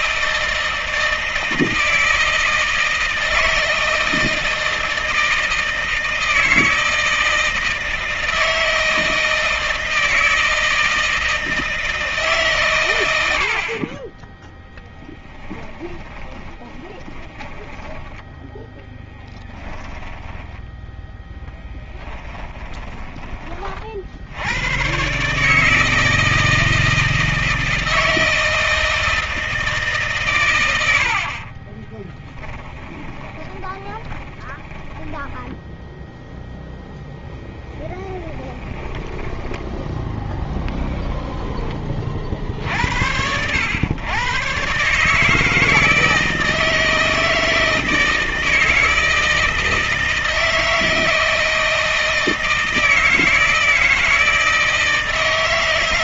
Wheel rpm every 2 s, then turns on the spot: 160, 160, 160, 160, 160, 160, 100, 10, 20, 10, 0, 20, 130, 160, 160, 90, 20, 20, 10, 10, 0, 80, 150, 160, 160, 160, 160, 160.
14-20 22-24 32-36 38-40